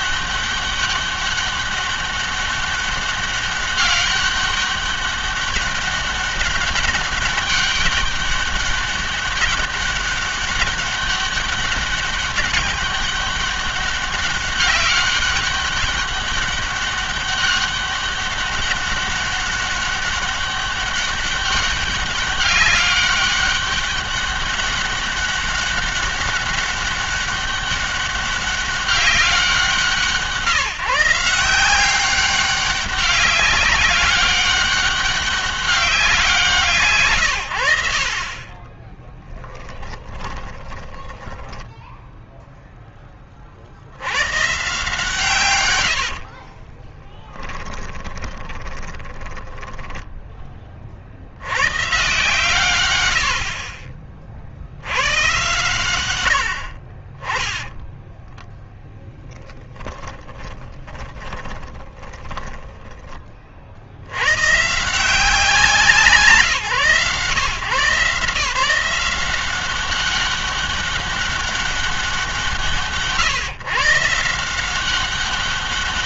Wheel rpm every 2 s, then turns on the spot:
200, 200, 200, 200, 200, 200, 200, 200, 200, 200, 200, 200, 200, 200, 190, 150, 200, 200, 160, 20, 20, 10, 130, 40, 20, 30, 130, 70, 50, 10, 10, 10, 130, 150, 170, 200, 170, 180.
38-42 46-50 56-64